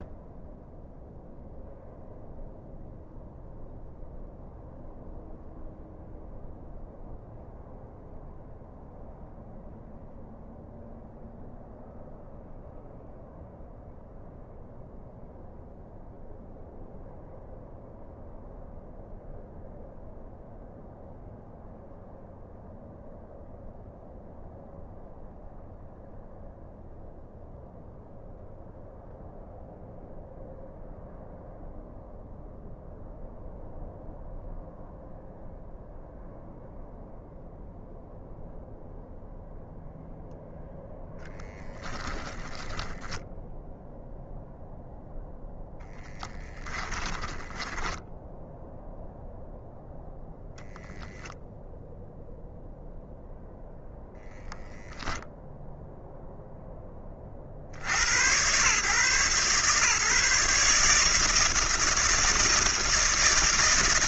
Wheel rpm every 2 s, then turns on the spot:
0, 0, 0, 0, 0, 0, 0, 0, 0, 0, 0, 0, 0, 0, 0, 0, 0, 0, 0, 0, 0, 10, 0, 10, 0, 0, 0, 0, 0, 120, 160, 160.
42-44 46-48